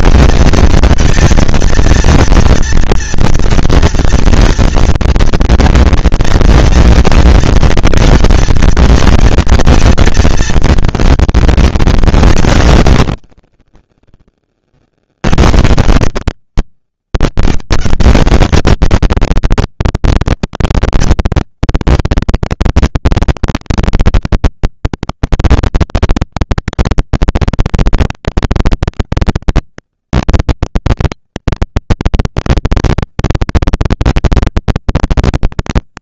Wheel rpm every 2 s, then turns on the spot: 230, 230, 230, 230, 230, 230, 100, 30, 80, 220, 200, 200, 200, 190, 210, 230, 220, 220.
none